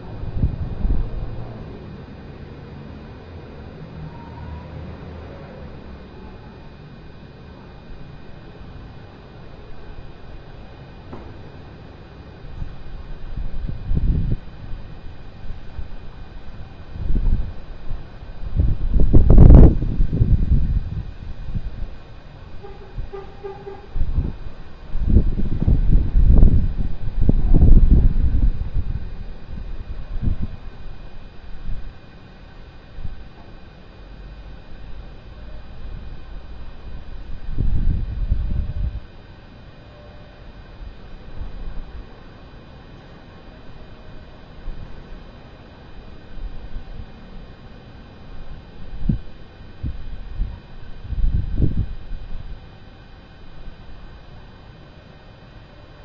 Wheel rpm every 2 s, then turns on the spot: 0, 0, 0, 0, 0, 0, 0, 0, 0, 0, 0, 0, 0, 0, 0, 0, 0, 0, 0, 0, 0, 0, 0, 0, 0, 0, 0, 0.
none